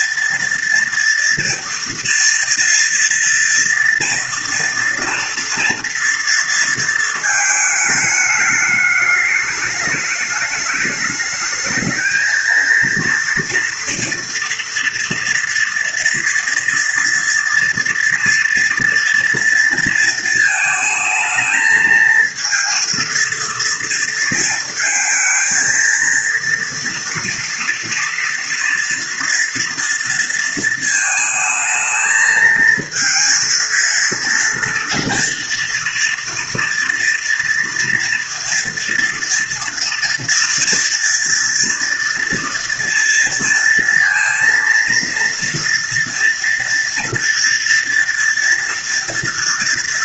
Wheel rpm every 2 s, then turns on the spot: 230, 240, 230, 230, 210, 210, 230, 230, 230, 230, 230, 230, 230, 230, 230, 230, 220, 230, 230, 230, 240, 230, 230, 230, 230.
none